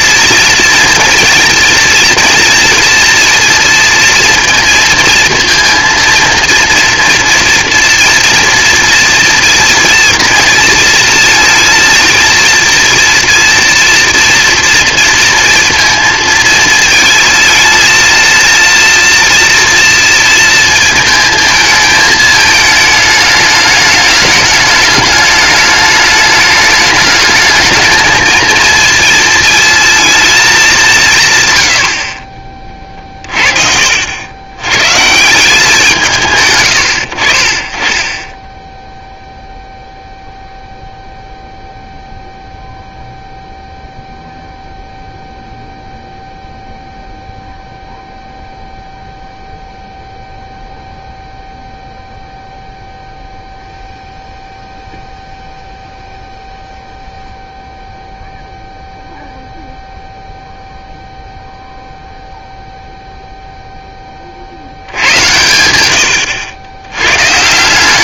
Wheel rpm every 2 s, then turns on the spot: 230, 230, 230, 230, 230, 230, 240, 230, 230, 230, 230, 220, 210, 210, 230, 200, 30, 110, 120, 10, 0, 0, 0, 0, 0, 0, 0, 0, 0, 0, 0, 0, 60, 100.
32-34